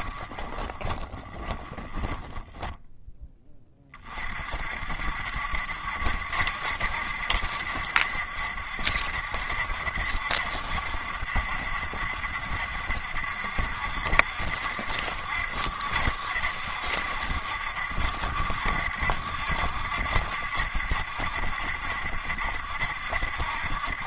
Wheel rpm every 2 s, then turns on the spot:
20, 10, 50, 70, 70, 70, 70, 70, 70, 60, 70, 70.
0-4